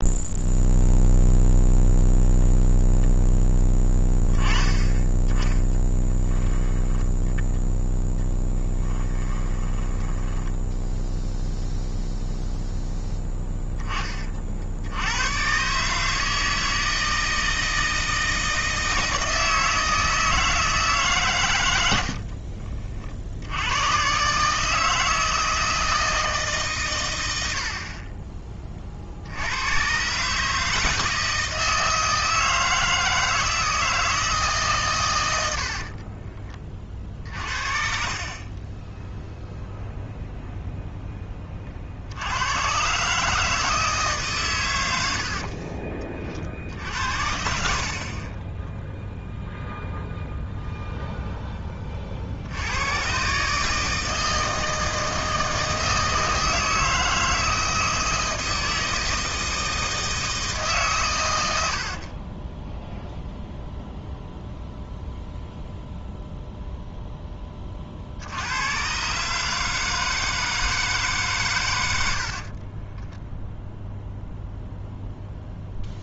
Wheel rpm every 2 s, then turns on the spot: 0, 0, 10, 10, 10, 0, 0, 90, 160, 160, 150, 50, 160, 120, 50, 160, 160, 120, 40, 10, 0, 130, 90, 60, 0, 0, 110, 160, 160, 160, 130, 0, 0, 0, 130, 150, 20, 0.
8-10 38-40 72-74